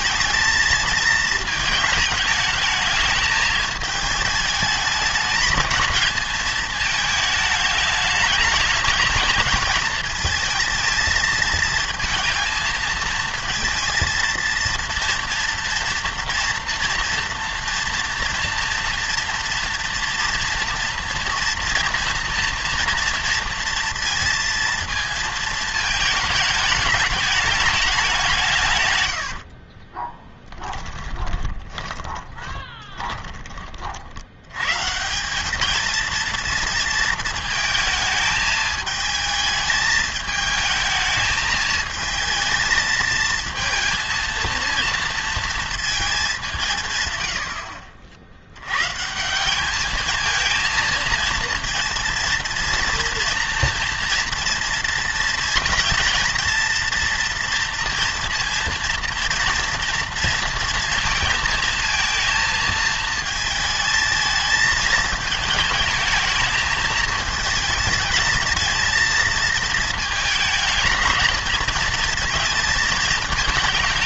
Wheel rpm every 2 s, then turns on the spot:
220, 220, 220, 220, 210, 220, 230, 230, 230, 230, 230, 230, 230, 210, 140, 10, 20, 120, 230, 220, 220, 220, 230, 170, 110, 220, 230, 230, 230, 230, 230, 230, 220, 220, 230, 220, 220.
30-34